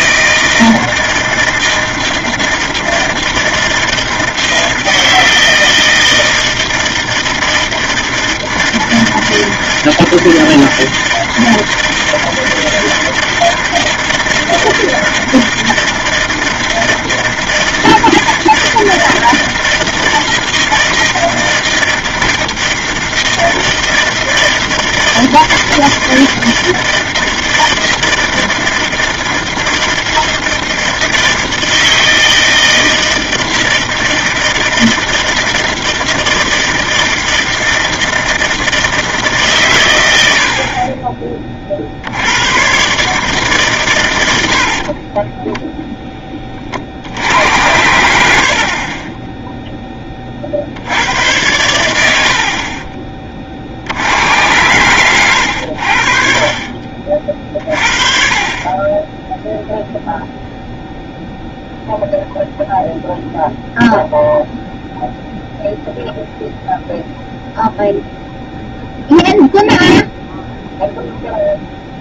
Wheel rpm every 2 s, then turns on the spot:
160, 160, 160, 160, 160, 160, 160, 160, 160, 160, 160, 160, 160, 160, 160, 160, 160, 160, 160, 160, 30, 140, 50, 60, 40, 90, 30, 100, 40, 20, 0, 0, 0, 0, 0, 0.
48-50 54-56